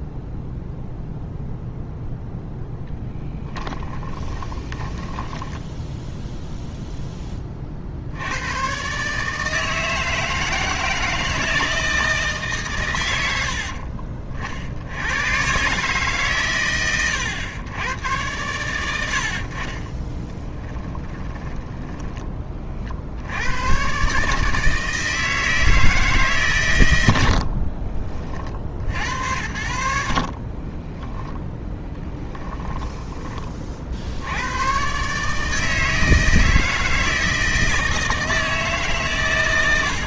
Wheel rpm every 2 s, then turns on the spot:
0, 0, 20, 0, 130, 160, 140, 70, 110, 90, 10, 30, 160, 130, 60, 20, 10, 110, 160, 150.
4-6 20-22 30-34